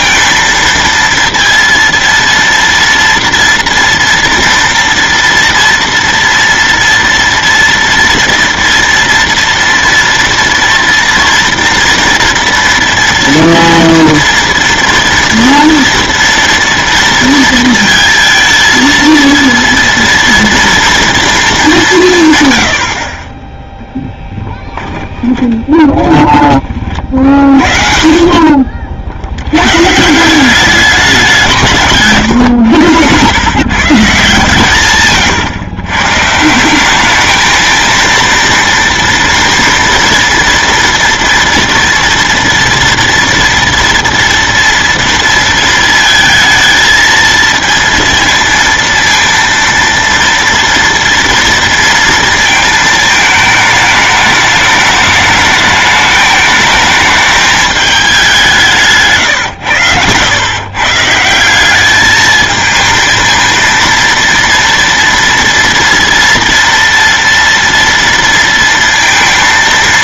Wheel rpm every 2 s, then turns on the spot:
230, 230, 240, 230, 230, 230, 230, 230, 230, 230, 230, 80, 20, 30, 50, 200, 110, 130, 190, 230, 230, 230, 230, 230, 230, 230, 220, 210, 210, 170, 140, 220, 230, 230, 230.
24-26